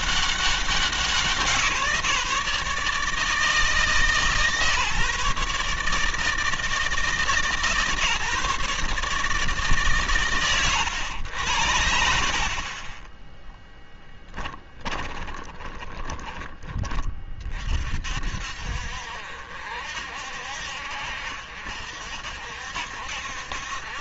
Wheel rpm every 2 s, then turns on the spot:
190, 150, 150, 150, 140, 110, 30, 10, 30, 60, 60, 60.
14-16